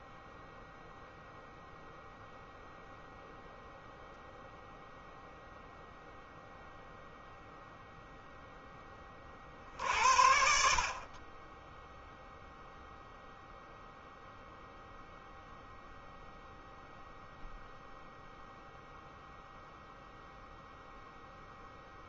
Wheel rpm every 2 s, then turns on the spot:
0, 0, 0, 0, 20, 40, 0, 0, 0, 0, 0.
none